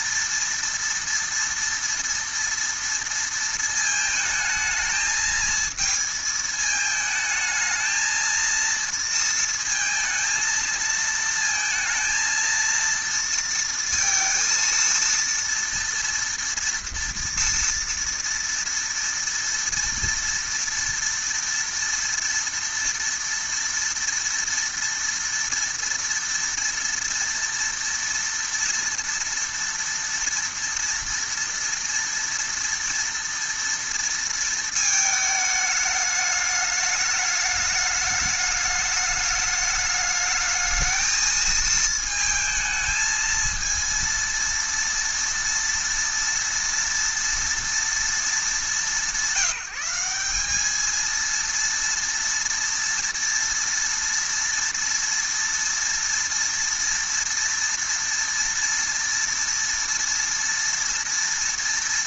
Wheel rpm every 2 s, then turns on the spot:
230, 230, 220, 220, 230, 220, 230, 230, 230, 230, 230, 230, 230, 230, 230, 230, 230, 230, 210, 210, 220, 220, 230, 230, 210, 200, 240, 230, 230, 230, 230.
none